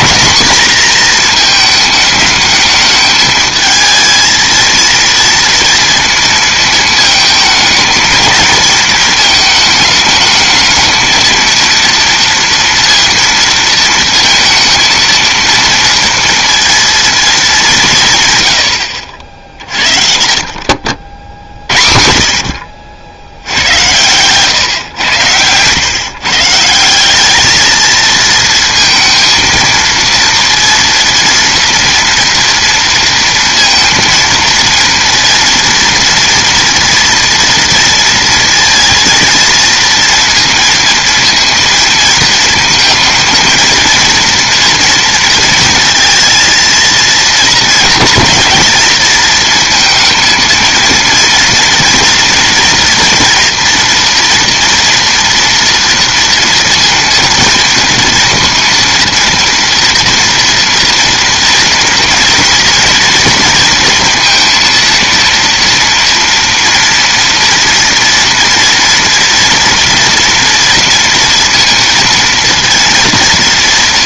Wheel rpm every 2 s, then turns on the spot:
230, 220, 220, 230, 220, 220, 230, 230, 230, 110, 60, 70, 120, 160, 230, 230, 230, 230, 230, 230, 230, 230, 230, 230, 220, 230, 230, 230, 230, 230, 230, 230, 230, 230, 240, 230, 230.
none